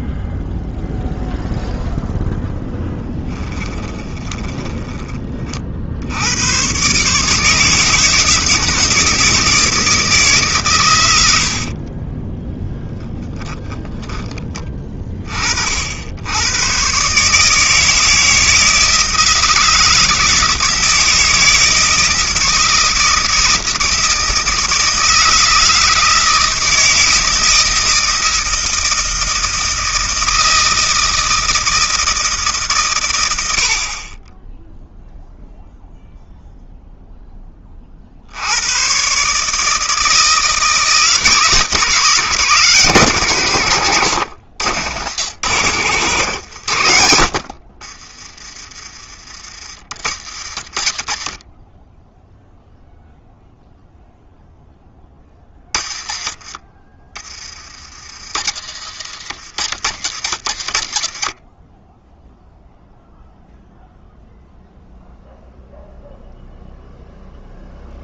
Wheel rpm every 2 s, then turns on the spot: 0, 0, 10, 120, 160, 130, 0, 20, 120, 160, 160, 160, 160, 160, 160, 160, 150, 0, 0, 90, 160, 180, 100, 90, 30, 60, 0, 10, 30, 70, 60, 0, 0, 0.
4-6 46-48 50-52